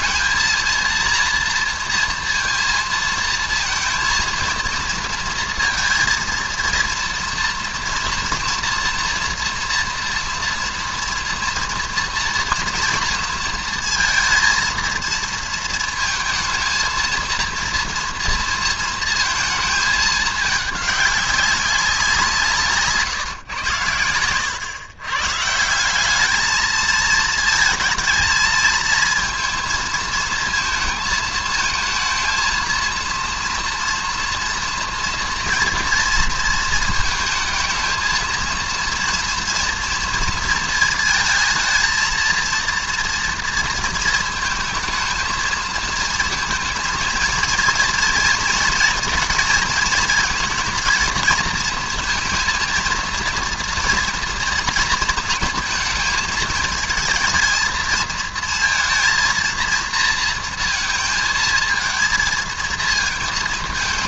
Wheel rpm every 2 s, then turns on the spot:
230, 230, 230, 230, 230, 230, 230, 230, 230, 230, 210, 160, 100, 220, 220, 220, 230, 230, 230, 230, 230, 230, 220, 230, 230, 230, 230, 230, 220, 230, 230, 220.
none